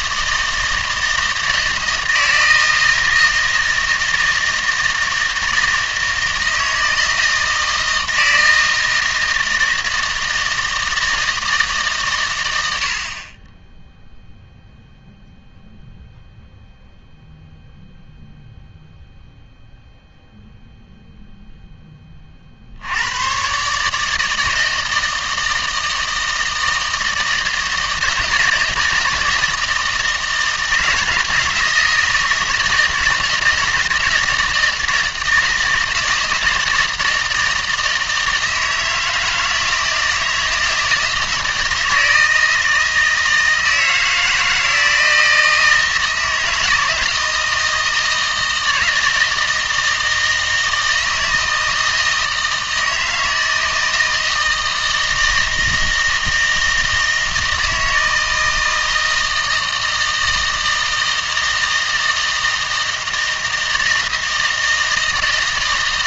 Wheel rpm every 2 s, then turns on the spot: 160, 160, 160, 160, 160, 160, 80, 0, 0, 0, 0, 50, 160, 160, 160, 160, 160, 160, 160, 160, 160, 160, 160, 160, 160, 160, 160, 160, 160, 160, 160, 160, 160.
none